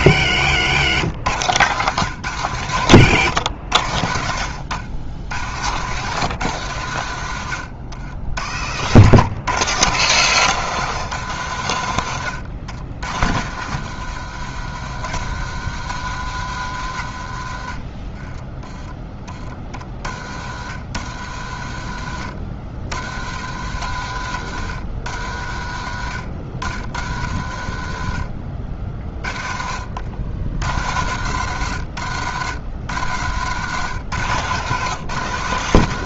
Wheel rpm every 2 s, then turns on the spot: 100, 110, 80, 110, 80, 150, 80, 90, 90, 10, 50, 60, 80, 60, 40, 80, 100, 130.
none